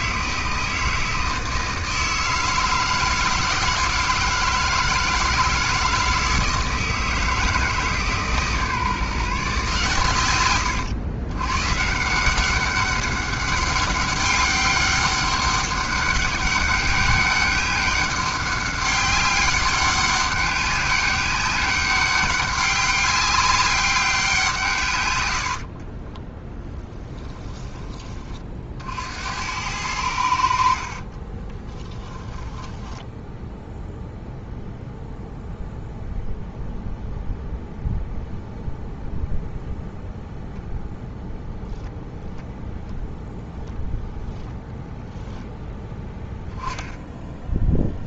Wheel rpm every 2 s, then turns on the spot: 160, 160, 160, 160, 150, 110, 190, 200, 200, 200, 200, 200, 140, 20, 50, 50, 10, 0, 0, 0, 0, 0, 0, 10.
26-28 30-34